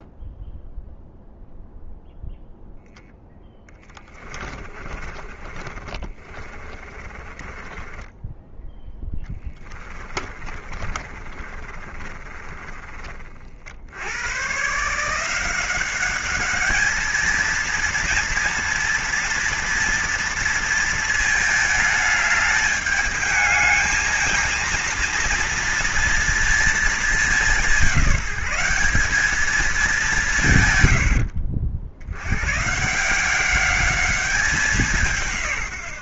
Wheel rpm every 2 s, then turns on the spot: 0, 0, 20, 40, 10, 30, 30, 130, 210, 230, 230, 210, 230, 230, 190, 140, 140, 190.
4-8 10-14